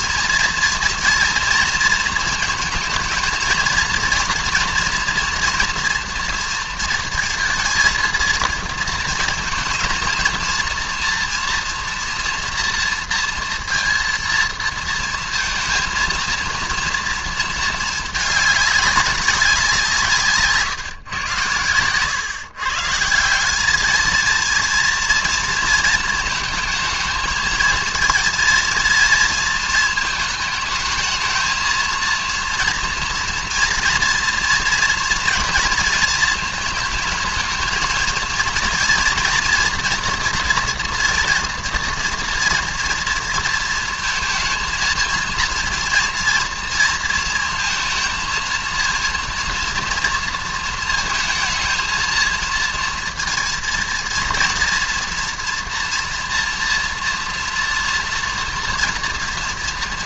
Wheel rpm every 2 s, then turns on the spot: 230, 230, 230, 230, 220, 230, 230, 230, 230, 200, 150, 140, 230, 220, 230, 220, 230, 230, 220, 230, 240, 240, 230, 230, 230, 230, 230, 240, 230, 230.
none